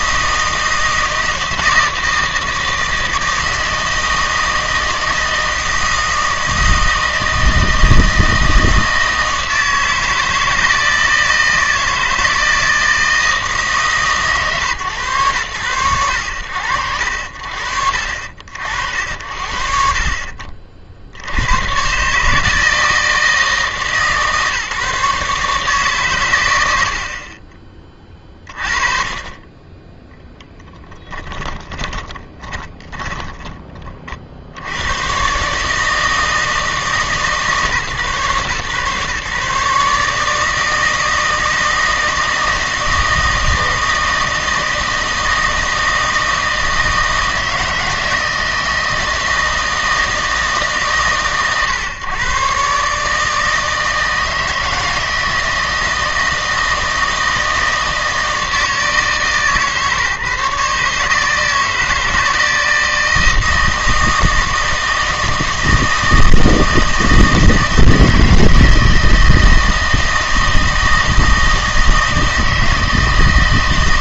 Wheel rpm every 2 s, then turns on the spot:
160, 160, 160, 160, 160, 160, 160, 120, 60, 60, 60, 160, 140, 90, 30, 20, 10, 90, 160, 140, 160, 160, 160, 160, 160, 140, 140, 160, 160, 160, 150, 160, 160, 160, 160, 160, 160.
30-34